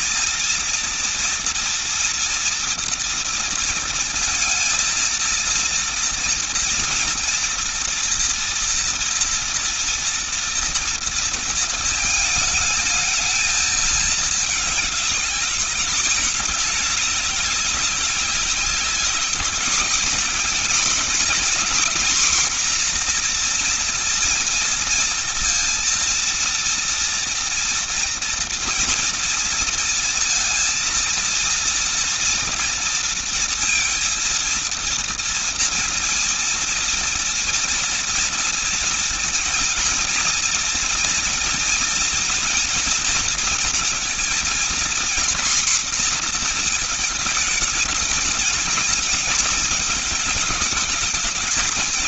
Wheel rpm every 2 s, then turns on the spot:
230, 230, 230, 230, 230, 230, 220, 210, 200, 200, 240, 250, 230, 230, 230, 230, 230, 230, 230, 230, 230, 230, 230, 230, 230, 220.
none